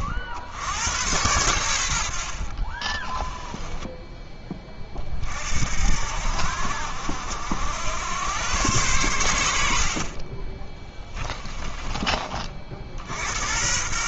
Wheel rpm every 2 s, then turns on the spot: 80, 50, 20, 70, 110, 20, 50.
2-4 10-12